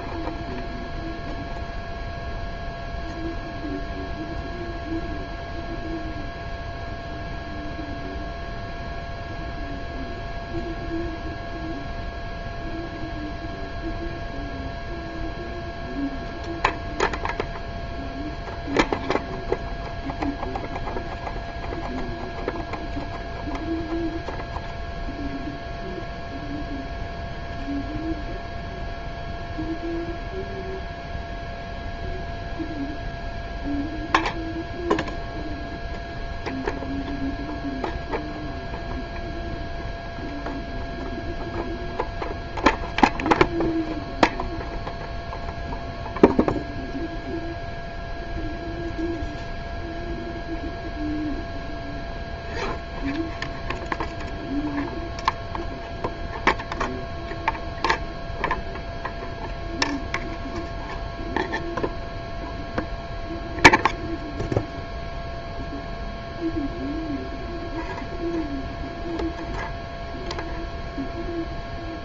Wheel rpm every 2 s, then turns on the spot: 0, 0, 0, 0, 0, 0, 0, 0, 0, 0, 0, 0, 0, 0, 0, 0, 0, 0, 0, 0, 0, 0, 0, 0, 0, 0, 0, 0, 0, 0, 0, 0, 0, 0, 0, 0.
none